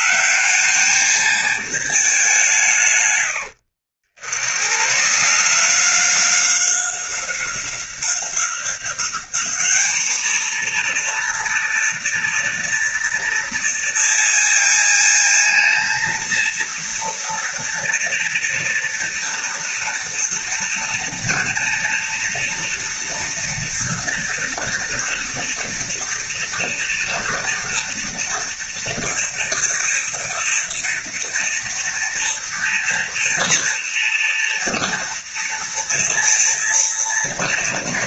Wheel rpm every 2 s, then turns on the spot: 210, 140, 130, 190, 190, 230, 230, 230, 230, 230, 230, 230, 230, 230, 230, 240, 230, 230, 230.
none